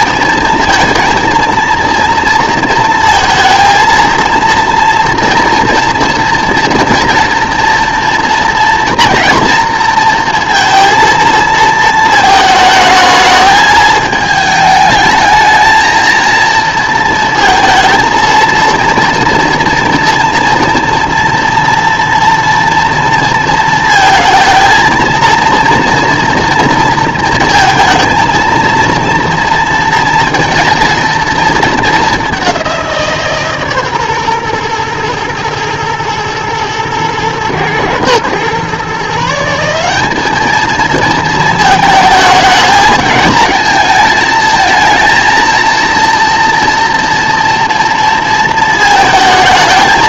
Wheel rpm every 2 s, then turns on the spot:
230, 230, 230, 230, 230, 230, 220, 220, 230, 230, 230, 230, 230, 230, 230, 230, 190, 120, 110, 130, 220, 220, 220, 230, 220.
none